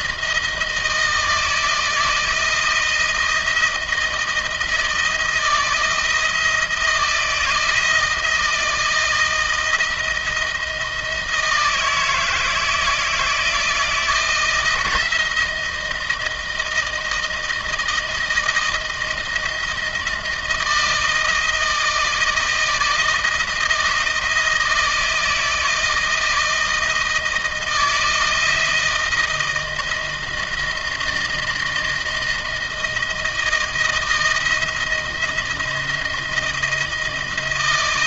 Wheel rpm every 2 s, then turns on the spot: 160, 160, 160, 160, 160, 160, 160, 160, 160, 160, 160, 160, 160, 160, 160, 170, 170, 170, 160.
none